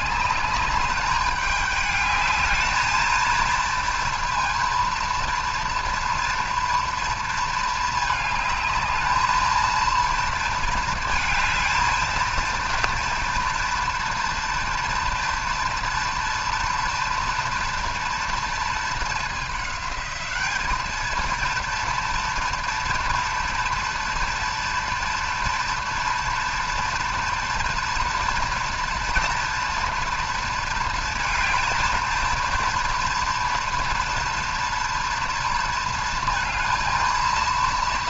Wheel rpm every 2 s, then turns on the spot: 210, 220, 230, 230, 220, 230, 230, 240, 230, 220, 210, 230, 230, 230, 230, 230, 230, 230, 220.
none